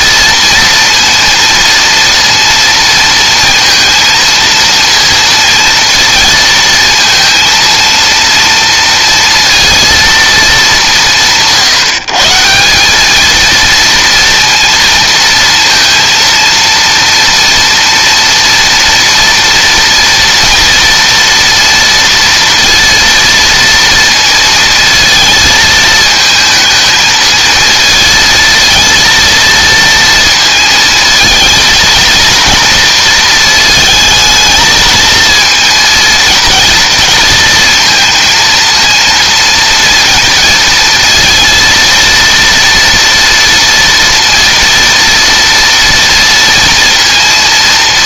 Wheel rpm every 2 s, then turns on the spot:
230, 230, 230, 220, 230, 210, 180, 230, 230, 230, 230, 230, 230, 220, 230, 230, 230, 220, 230, 230, 230, 230, 230, 230.
none